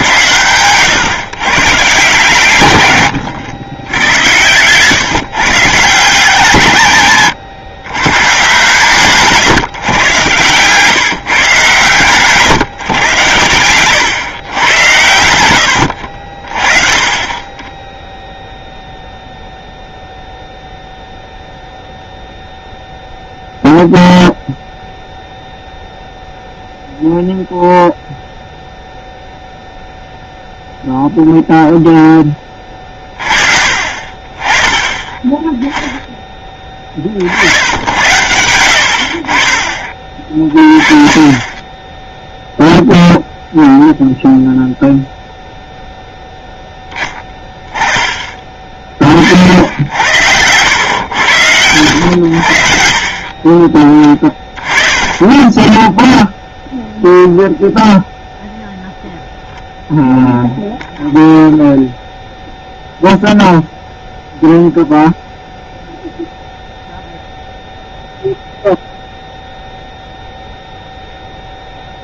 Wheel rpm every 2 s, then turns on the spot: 110, 130, 110, 150, 130, 130, 140, 110, 40, 0, 0, 0, 0, 0, 0, 0, 20, 20, 20, 80, 40, 0, 0, 10, 20, 90, 80, 20, 0, 0, 0, 0, 0, 0, 0, 0.
none